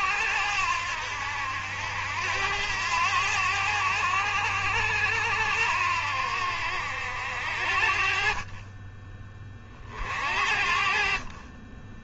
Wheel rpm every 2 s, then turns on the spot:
70, 80, 90, 70, 30, 50.
none